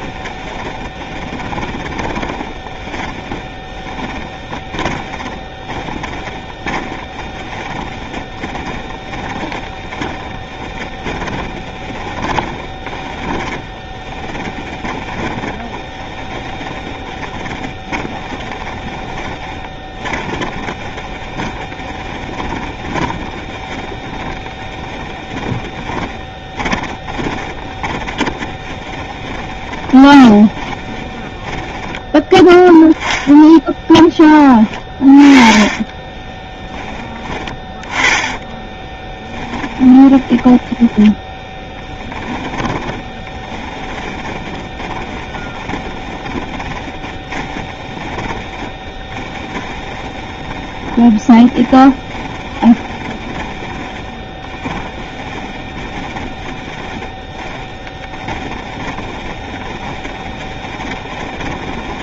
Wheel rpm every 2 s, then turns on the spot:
20, 20, 20, 10, 20, 20, 20, 20, 20, 20, 20, 20, 10, 20, 20, 20, 10, 20, 20, 10, 10, 20, 20, 20, 20, 20, 20, 30, 20, 20, 30.
0-34 38-62